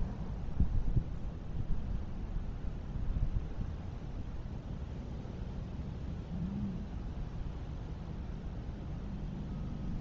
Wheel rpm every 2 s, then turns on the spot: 0, 0, 0, 0, 0.
none